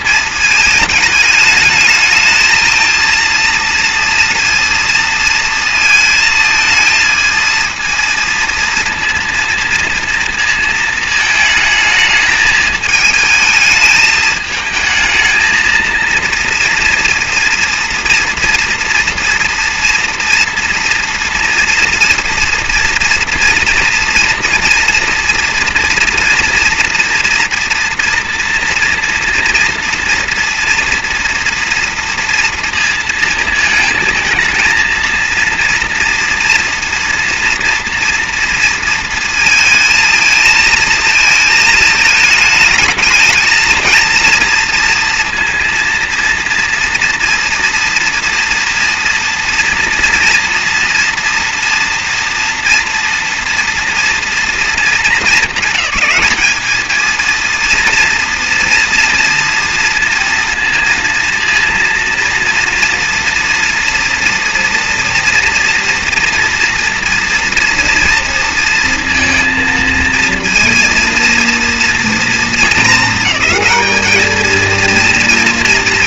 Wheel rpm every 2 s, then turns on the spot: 220, 220, 230, 220, 230, 220, 220, 220, 230, 230, 230, 230, 230, 230, 230, 230, 230, 220, 230, 230, 220, 210, 230, 230, 230, 230, 230, 230, 220, 240, 230, 230, 240, 230, 230, 230, 220, 230.
none